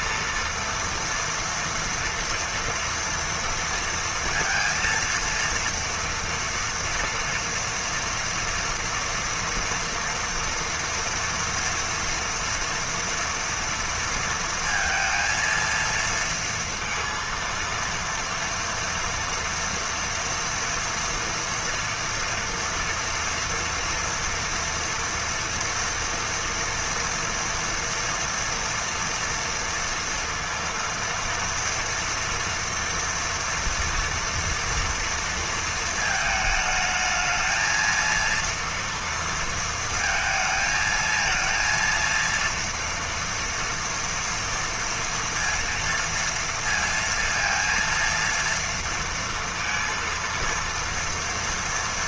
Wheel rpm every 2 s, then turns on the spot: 230, 230, 230, 230, 230, 230, 230, 230, 230, 240, 230, 240, 230, 230, 230, 230, 230, 230, 220, 230, 220, 230, 230, 230, 230, 230.
none